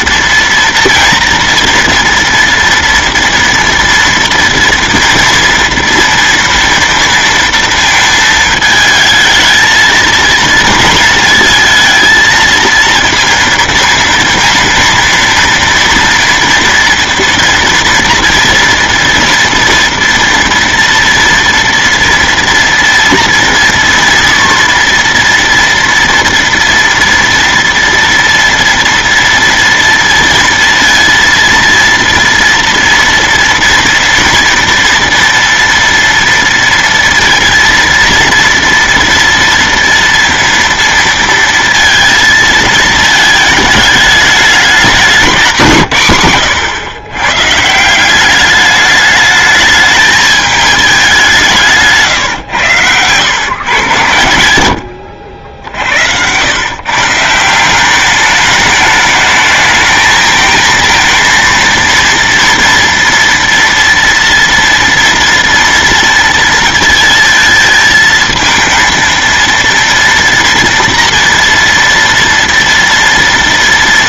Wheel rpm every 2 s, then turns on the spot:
230, 230, 230, 230, 220, 230, 230, 230, 230, 230, 230, 230, 230, 230, 230, 230, 230, 240, 230, 230, 230, 220, 210, 110, 210, 210, 110, 90, 130, 210, 220, 230, 230, 230, 220, 230, 230.
none